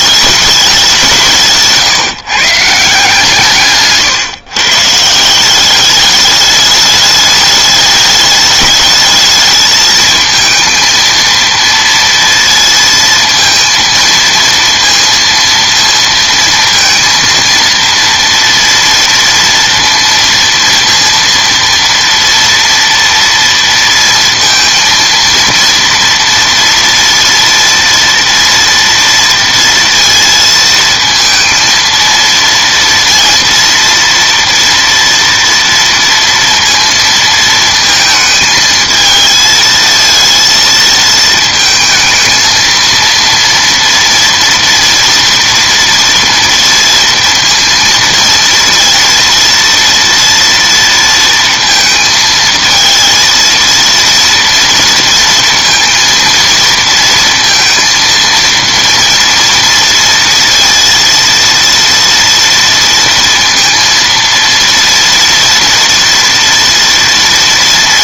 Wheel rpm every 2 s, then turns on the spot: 200, 160, 130, 210, 210, 220, 230, 230, 230, 230, 230, 230, 230, 230, 230, 230, 230, 230, 230, 220, 230, 230, 240, 230, 230, 230, 220, 230, 230, 230, 230, 230, 230, 230.
none